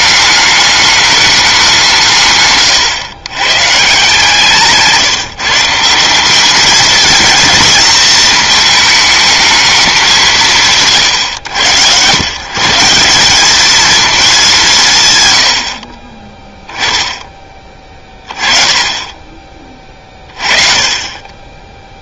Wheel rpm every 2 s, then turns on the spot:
210, 140, 160, 210, 220, 150, 170, 180, 10, 20, 30.
none